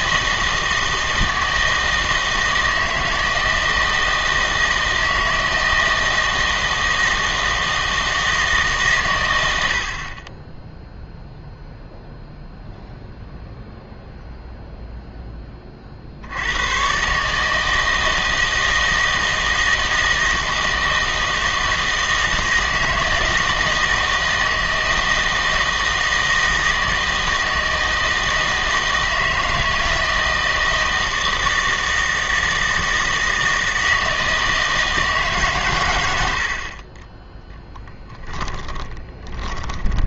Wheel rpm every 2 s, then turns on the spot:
160, 160, 160, 160, 150, 10, 0, 0, 100, 160, 160, 160, 160, 160, 160, 160, 160, 160, 50, 10.
38-40